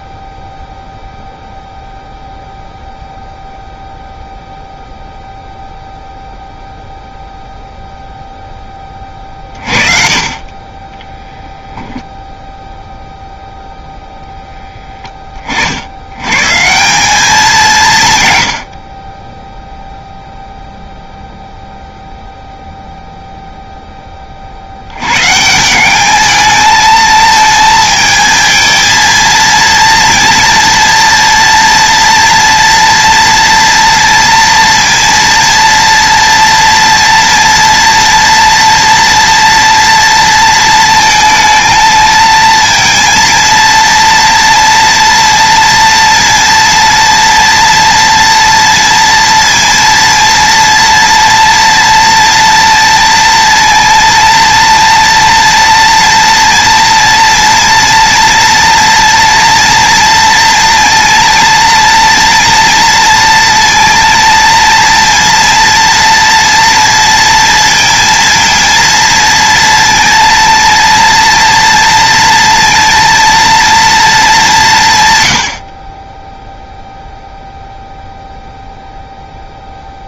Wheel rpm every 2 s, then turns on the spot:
0, 0, 0, 0, 20, 20, 0, 10, 180, 40, 0, 0, 90, 220, 220, 240, 230, 230, 230, 230, 220, 230, 230, 230, 230, 230, 230, 230, 230, 230, 230, 230, 230, 230, 230, 230, 230, 140, 0, 0.
none